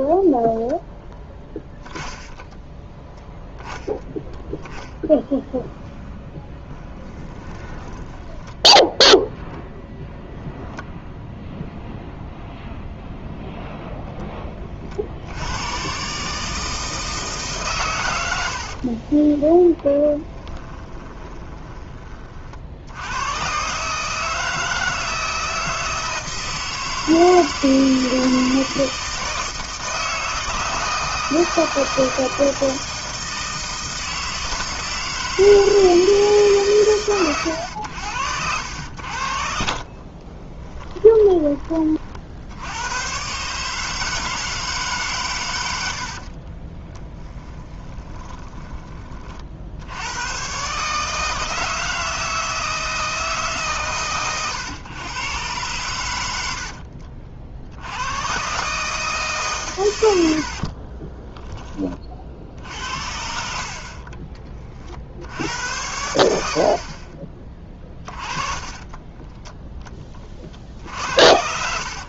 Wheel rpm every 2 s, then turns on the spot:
0, 10, 0, 10, 10, 0, 0, 20, 160, 70, 20, 60, 160, 160, 160, 160, 160, 160, 140, 80, 20, 90, 150, 30, 20, 130, 160, 110, 70, 140, 60, 50, 30, 50, 20, 50.
2-4 6-8 18-22 40-42 46-50 56-58 60-62 68-70